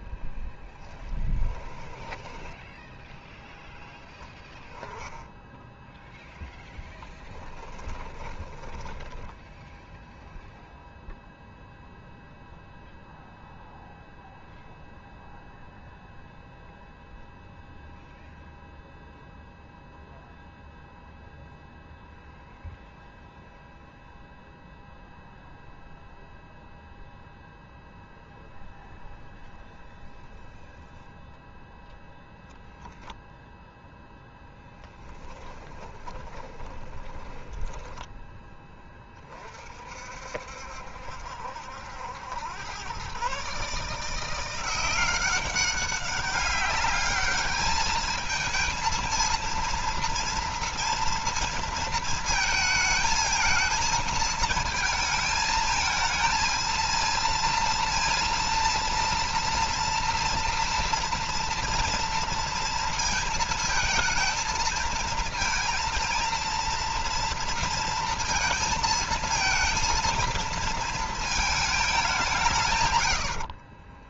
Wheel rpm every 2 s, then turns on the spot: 10, 10, 10, 20, 20, 0, 0, 0, 0, 0, 0, 0, 0, 0, 0, 0, 0, 10, 10, 20, 70, 110, 180, 200, 230, 230, 220, 220, 230, 230, 230, 230, 230, 230, 230, 230, 110.
0-4 8-10 34-38